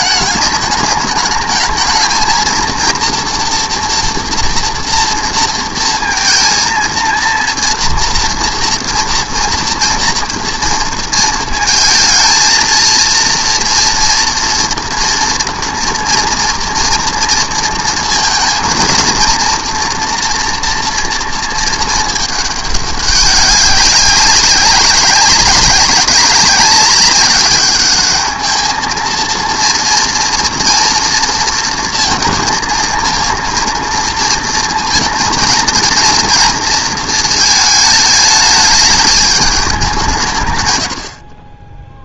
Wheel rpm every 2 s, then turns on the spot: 210, 240, 230, 230, 230, 230, 230, 240, 230, 230, 230, 200, 190, 190, 230, 230, 230, 230, 230, 210, 80.
none